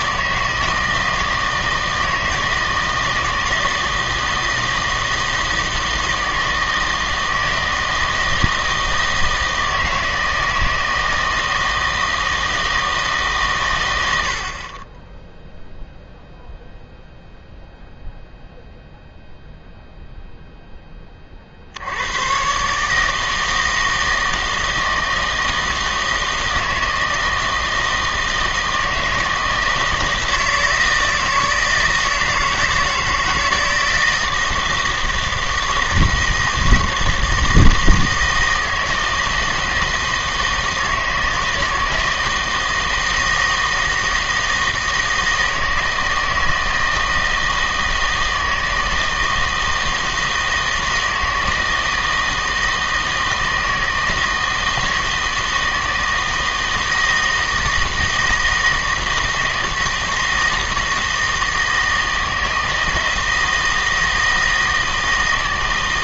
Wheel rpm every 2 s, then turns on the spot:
160, 160, 160, 160, 160, 160, 160, 30, 0, 0, 10, 140, 160, 160, 160, 160, 160, 160, 160, 160, 160, 160, 160, 160, 160, 160, 160, 160, 160, 160, 160, 160, 160.
none